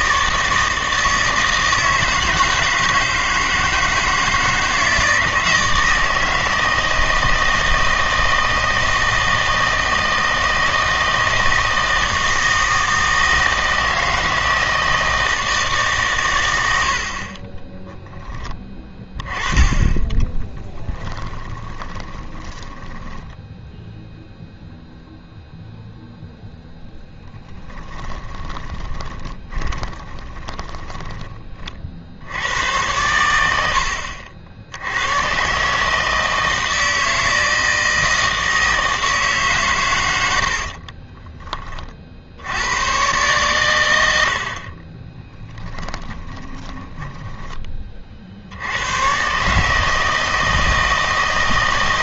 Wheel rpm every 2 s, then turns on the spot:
160, 160, 160, 160, 160, 160, 160, 160, 80, 20, 10, 20, 0, 20, 20, 20, 100, 70, 160, 160, 50, 100, 40, 10, 90, 160.
20-24 26-32 40-42 46-48